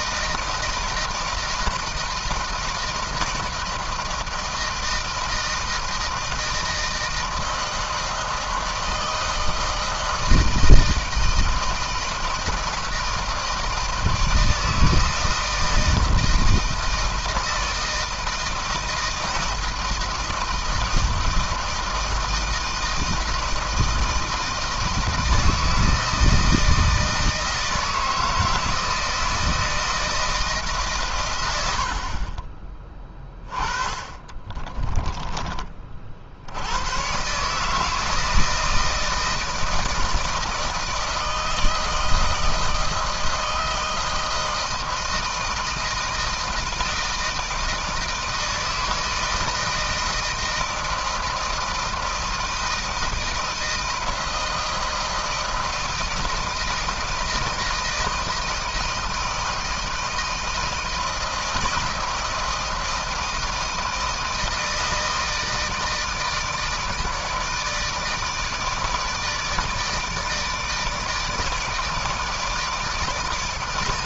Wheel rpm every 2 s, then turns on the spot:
160, 160, 160, 160, 160, 160, 160, 160, 160, 160, 160, 160, 160, 160, 160, 130, 20, 10, 100, 160, 160, 160, 160, 160, 160, 160, 160, 160, 160, 160, 160, 160, 160, 160, 160, 160, 160.
34-36